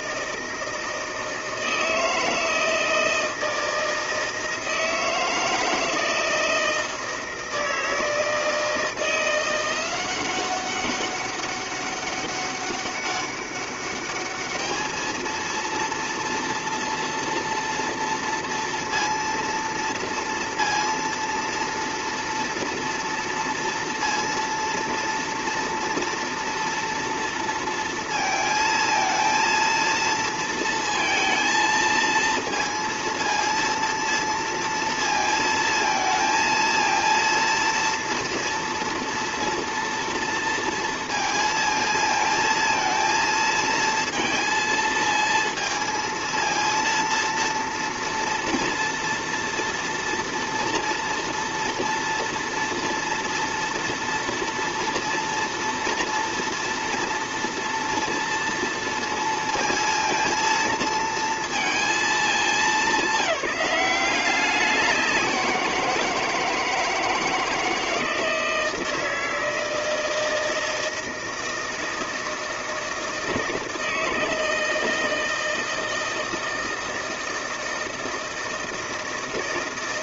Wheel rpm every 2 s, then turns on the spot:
160, 160, 160, 160, 160, 190, 200, 210, 230, 230, 230, 230, 230, 230, 230, 230, 230, 230, 220, 230, 230, 220, 230, 230, 230, 230, 230, 230, 230, 230, 230, 220, 190, 160, 160, 160, 160, 160, 160, 160.
none